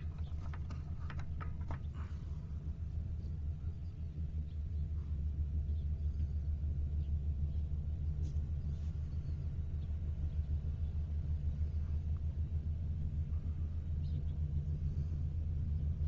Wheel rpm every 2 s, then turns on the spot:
0, 0, 0, 0, 0, 0, 0, 0.
none